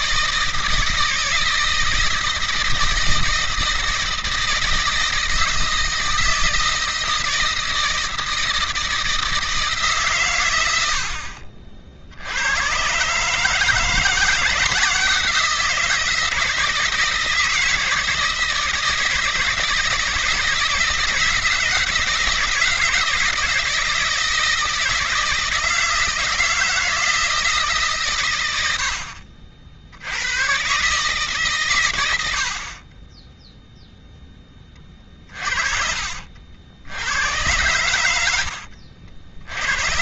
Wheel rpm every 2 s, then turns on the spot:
160, 160, 160, 160, 160, 90, 120, 160, 160, 160, 170, 170, 160, 160, 70, 130, 40, 20, 70, 70.
none